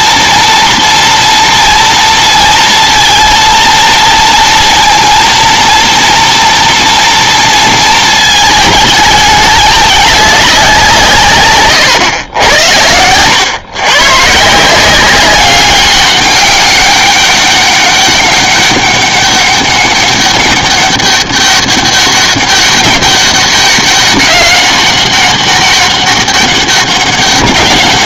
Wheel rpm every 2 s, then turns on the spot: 230, 230, 230, 240, 220, 200, 100, 160, 200, 200, 200, 200, 190, 200.
none